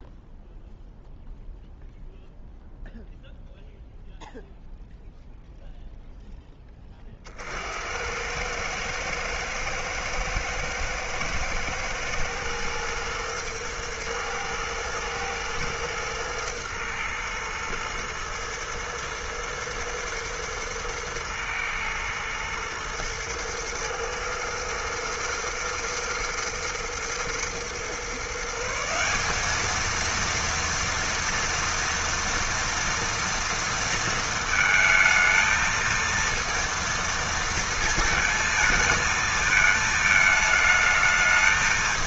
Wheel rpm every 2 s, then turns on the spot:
0, 0, 0, 10, 110, 110, 110, 110, 110, 120, 110, 120, 120, 110, 160, 230, 230, 220, 230, 220, 220.
none